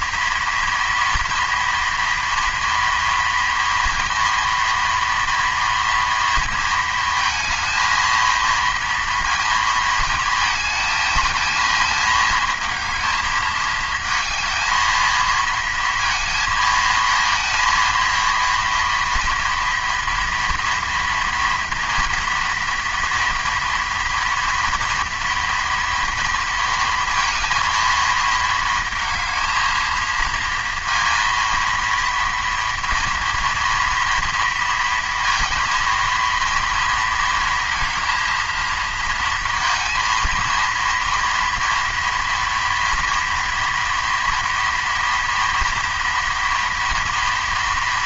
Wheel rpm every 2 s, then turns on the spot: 230, 230, 230, 230, 230, 220, 220, 220, 230, 240, 230, 230, 230, 230, 220, 230, 230, 230, 230, 230, 230, 230, 230, 230.
none